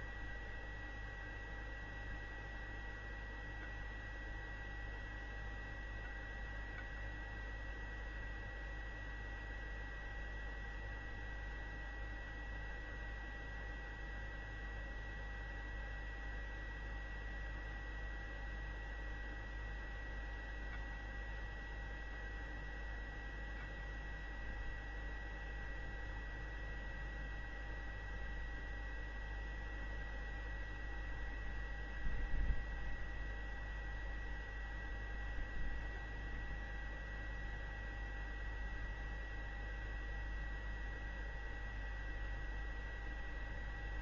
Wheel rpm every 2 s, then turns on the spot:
0, 0, 0, 0, 0, 0, 0, 0, 0, 0, 0, 0, 0, 0, 0, 0, 0, 0, 0, 0, 0, 0.
none